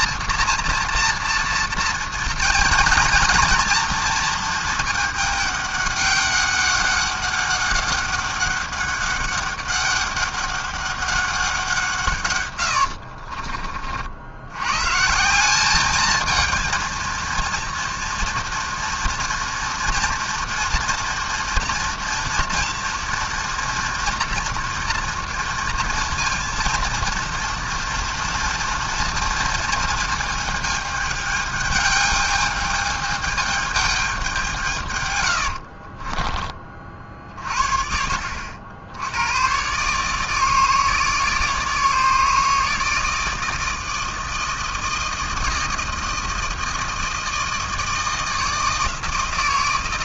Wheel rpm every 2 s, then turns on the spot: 230, 230, 220, 190, 200, 200, 100, 120, 230, 240, 230, 230, 230, 230, 230, 220, 210, 140, 50, 80, 160, 160, 160, 160, 160.
12-14